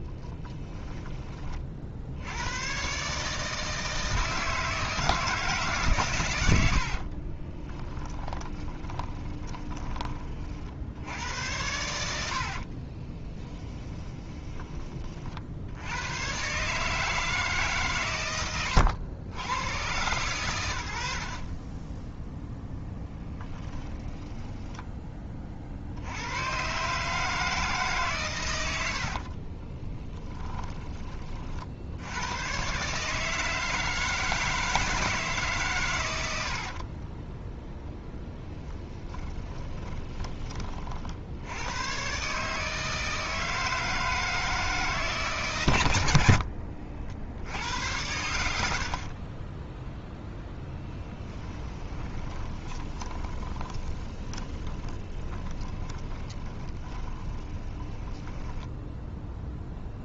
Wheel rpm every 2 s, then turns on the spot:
10, 130, 160, 50, 20, 60, 40, 40, 150, 80, 90, 10, 10, 140, 70, 20, 140, 160, 30, 20, 50, 160, 160, 70, 60, 20, 20, 20, 20, 0.
6-10 12-14 28-30 36-40 48-58